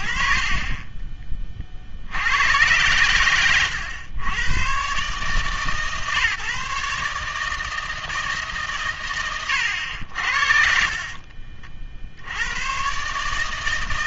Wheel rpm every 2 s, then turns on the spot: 50, 100, 120, 140, 150, 60, 110.
none